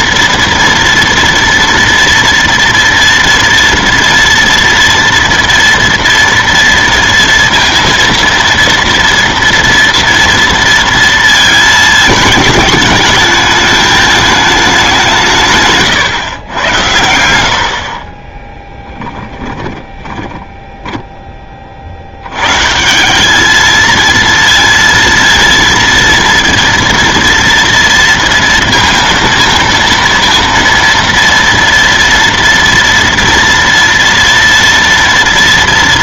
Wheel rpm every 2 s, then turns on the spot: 230, 230, 230, 230, 230, 230, 210, 210, 100, 10, 10, 120, 230, 230, 230, 230, 230, 230.
18-22